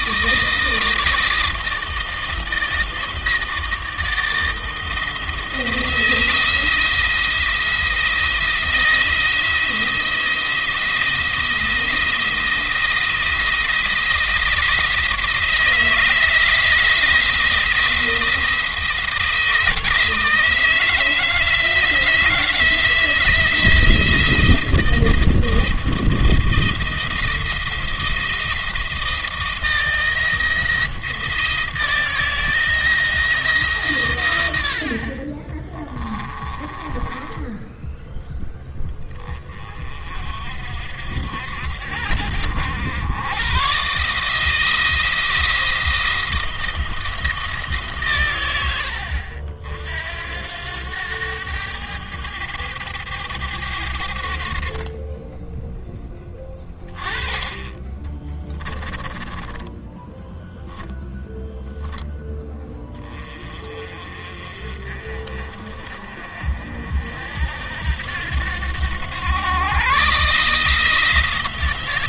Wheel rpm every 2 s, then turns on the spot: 160, 160, 170, 170, 170, 170, 170, 160, 170, 170, 160, 160, 160, 170, 170, 170, 160, 50, 20, 20, 60, 100, 160, 170, 100, 90, 100, 30, 10, 10, 0, 20, 40, 60, 100, 160.
36-38 58-60